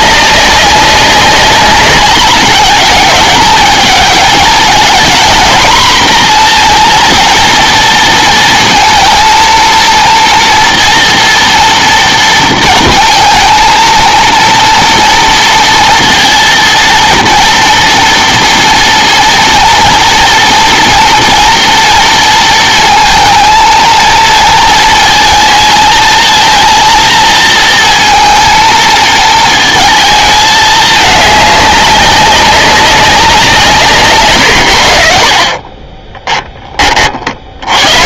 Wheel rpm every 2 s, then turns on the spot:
200, 210, 220, 230, 230, 230, 230, 230, 230, 230, 230, 230, 220, 230, 220, 210, 200, 80, 20.
none